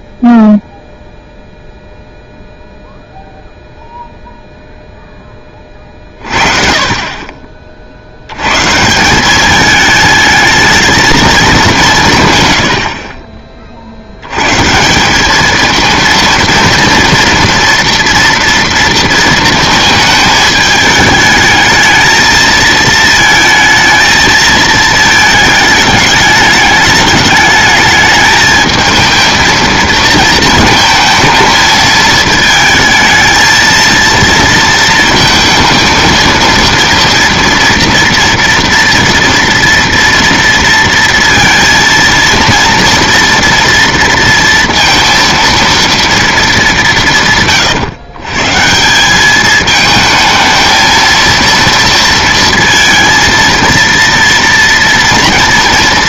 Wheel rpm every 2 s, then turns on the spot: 0, 0, 0, 40, 140, 220, 100, 130, 230, 230, 210, 220, 220, 210, 220, 230, 220, 230, 230, 230, 230, 230, 230, 210, 150, 220, 230, 230.
none